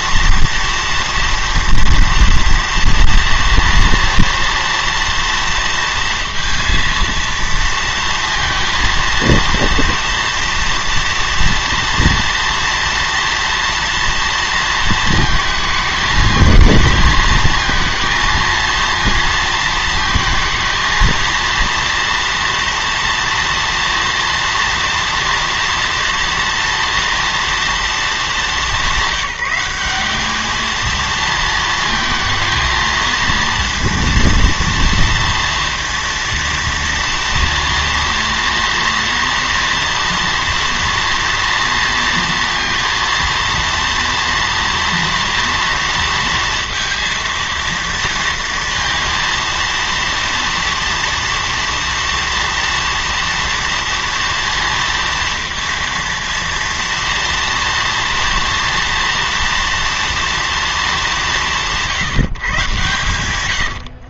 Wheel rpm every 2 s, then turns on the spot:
230, 230, 230, 230, 230, 230, 230, 230, 220, 230, 220, 230, 230, 230, 200, 220, 230, 230, 230, 240, 240, 230, 230, 230, 230, 230, 240, 230, 230, 230, 230, 130.
none